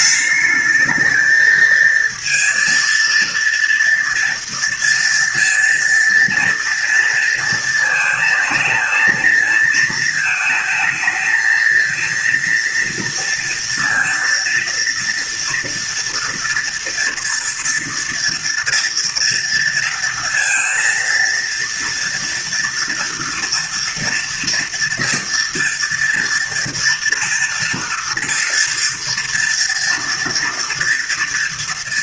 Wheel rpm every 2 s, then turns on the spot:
220, 230, 230, 230, 230, 220, 230, 240, 230, 230, 230, 230, 230, 230, 230, 230.
none